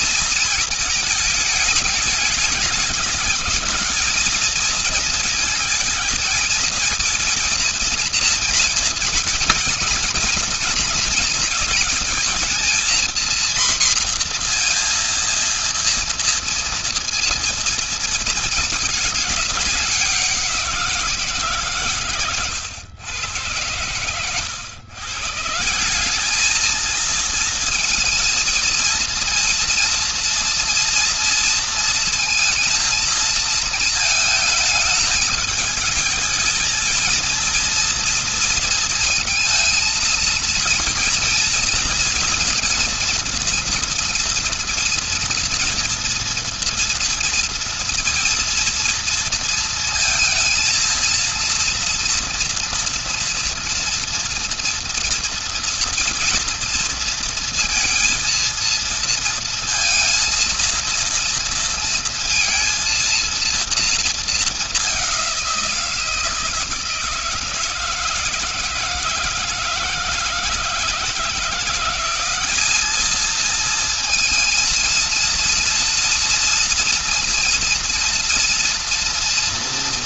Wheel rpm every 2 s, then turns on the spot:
220, 200, 210, 230, 230, 220, 230, 240, 230, 230, 190, 120, 110, 200, 230, 230, 230, 220, 220, 230, 230, 230, 230, 230, 230, 230, 230, 230, 230, 230, 230, 230, 220, 170, 160, 160, 190, 230, 230, 230.
none